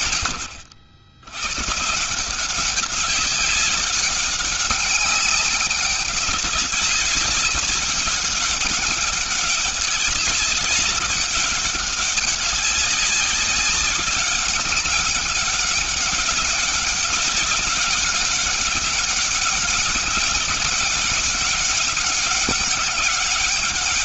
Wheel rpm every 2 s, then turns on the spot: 100, 200, 190, 190, 200, 200, 190, 190, 190, 200, 200, 200.
none